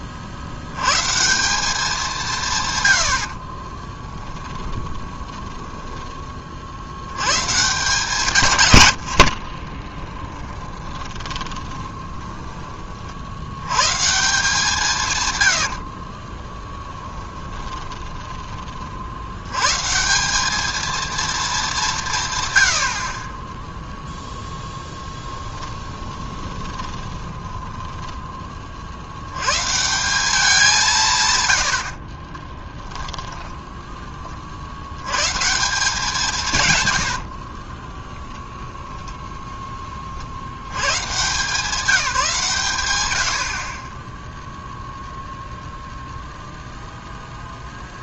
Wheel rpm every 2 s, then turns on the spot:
70, 140, 10, 40, 170, 20, 20, 160, 30, 20, 190, 120, 0, 20, 20, 180, 10, 50, 150, 20, 80, 150, 0, 0.
4-6 10-12 16-20 26-28 32-34 38-40